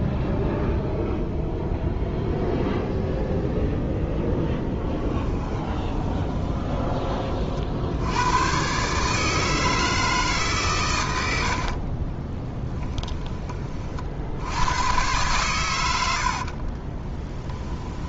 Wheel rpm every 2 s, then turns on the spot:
0, 0, 10, 20, 130, 130, 20, 100, 40.
4-6 12-14 16-18